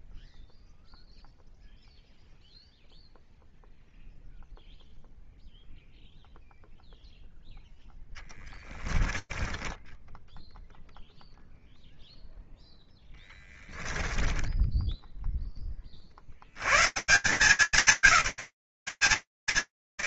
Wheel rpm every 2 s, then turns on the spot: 0, 0, 0, 0, 10, 0, 10, 10, 170, 170.
8-10 12-14